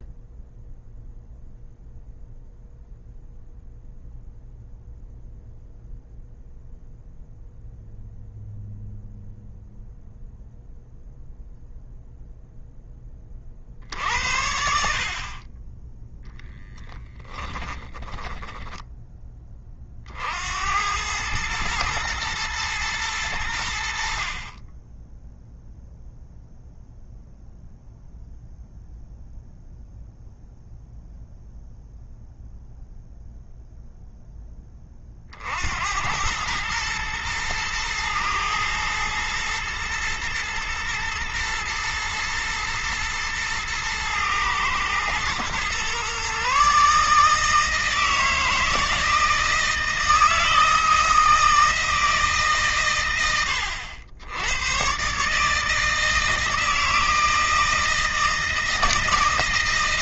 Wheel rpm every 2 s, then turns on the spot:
0, 0, 0, 0, 0, 0, 20, 60, 10, 10, 100, 110, 10, 0, 0, 0, 0, 40, 110, 110, 120, 110, 120, 150, 160, 160, 130, 120, 160, 160.
16-18